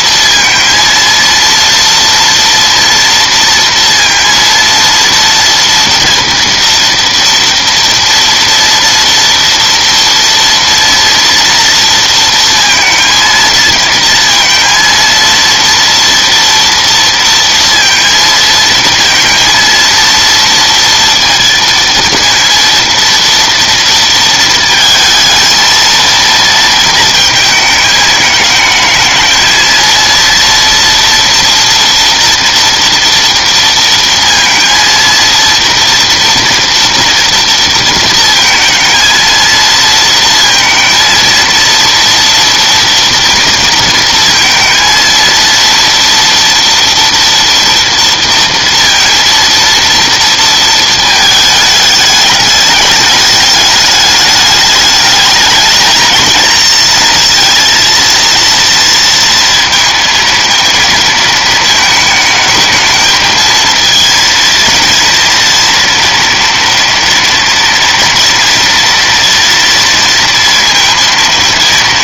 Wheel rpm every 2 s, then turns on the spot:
230, 230, 230, 230, 230, 230, 230, 230, 230, 230, 230, 230, 220, 220, 220, 230, 230, 230, 230, 230, 230, 230, 230, 230, 230, 220, 210, 220, 230, 230, 220, 220, 230, 230, 230, 230.
none